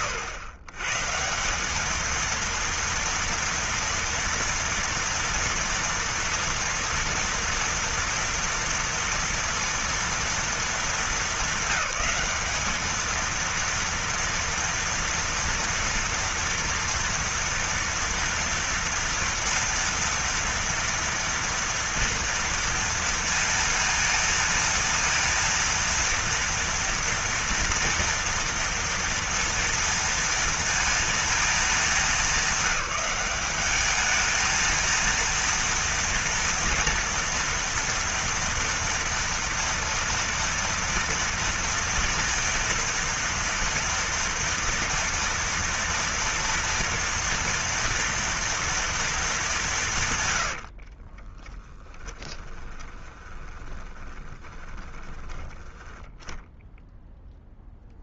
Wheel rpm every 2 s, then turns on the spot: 130, 230, 230, 230, 240, 220, 210, 230, 230, 230, 230, 230, 230, 230, 230, 230, 200, 230, 240, 230, 230, 230, 240, 230, 230, 40, 10, 10, 0.
50-56